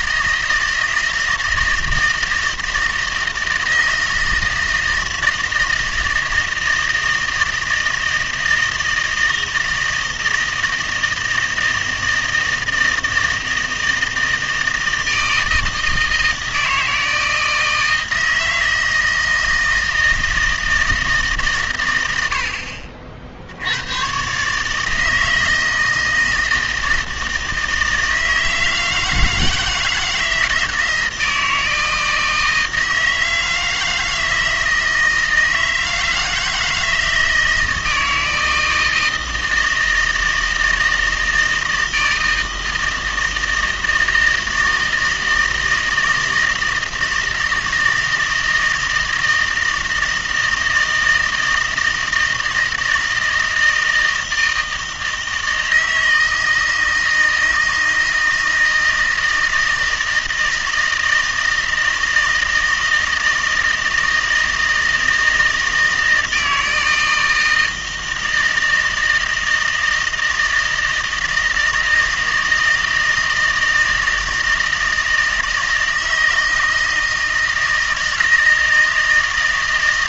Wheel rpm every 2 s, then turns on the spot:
160, 160, 160, 160, 160, 160, 160, 160, 160, 160, 160, 70, 150, 160, 160, 160, 160, 160, 160, 160, 160, 160, 160, 160, 160, 160, 160, 160, 160, 160, 160, 160, 160, 160, 160, 160, 160, 160, 160, 160.
none